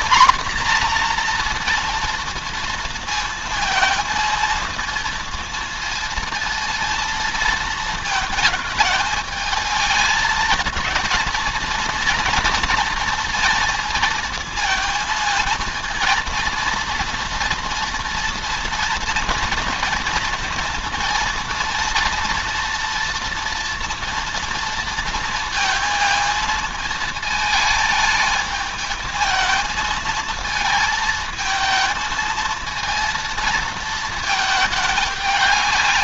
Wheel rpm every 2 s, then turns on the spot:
240, 230, 230, 230, 220, 230, 230, 230, 230, 230, 230, 230, 230, 220, 220, 220, 230, 210.
none